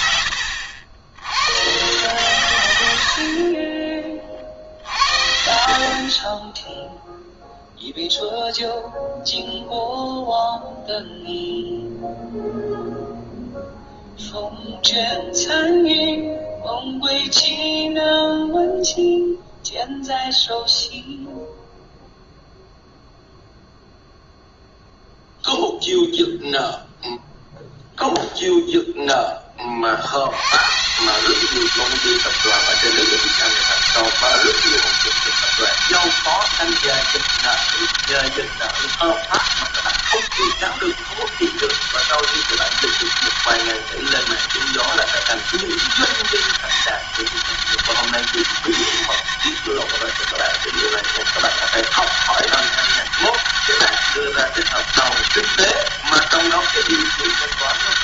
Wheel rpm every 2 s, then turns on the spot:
100, 120, 40, 10, 0, 0, 0, 0, 0, 0, 0, 0, 0, 0, 0, 110, 190, 200, 200, 200, 170, 200, 200, 200, 200, 200, 200, 200, 200.
none